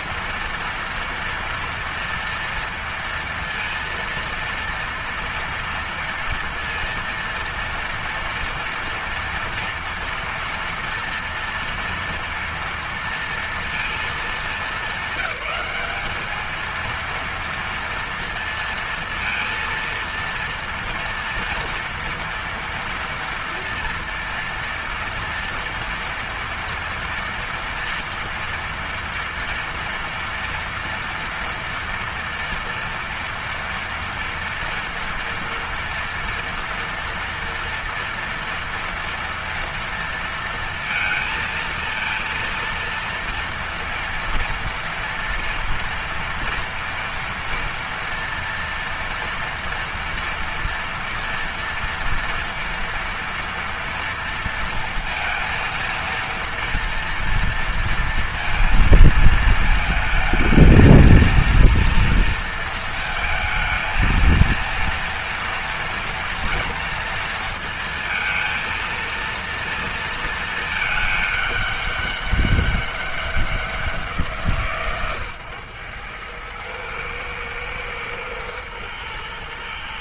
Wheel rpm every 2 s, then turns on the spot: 230, 230, 230, 230, 230, 230, 230, 210, 210, 230, 230, 230, 230, 230, 230, 230, 230, 230, 230, 240, 230, 230, 230, 230, 230, 240, 230, 230, 230, 230, 220, 230, 220, 230, 230, 230, 200, 160, 110, 120.
none